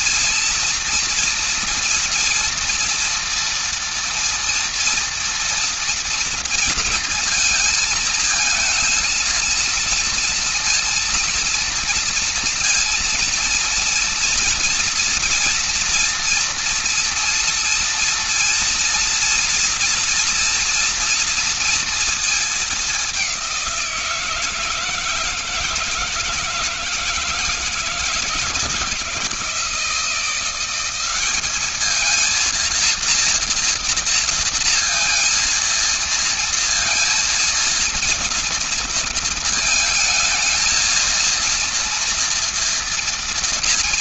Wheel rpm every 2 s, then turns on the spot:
230, 240, 230, 230, 230, 230, 230, 230, 230, 230, 230, 210, 160, 160, 160, 180, 230, 230, 230, 230, 220, 230.
none